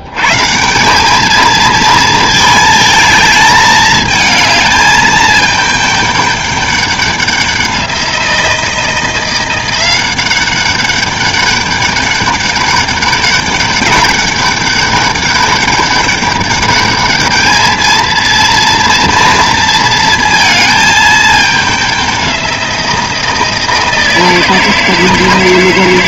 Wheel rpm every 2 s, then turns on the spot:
170, 220, 220, 200, 170, 200, 200, 200, 200, 230, 220, 180, 160.
none